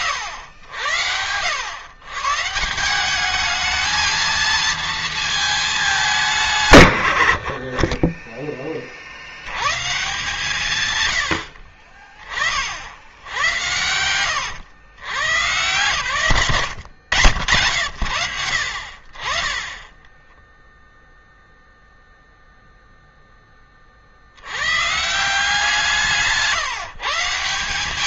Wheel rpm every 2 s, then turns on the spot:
90, 170, 230, 110, 10, 130, 40, 120, 110, 60, 0, 0, 150, 150.
16-18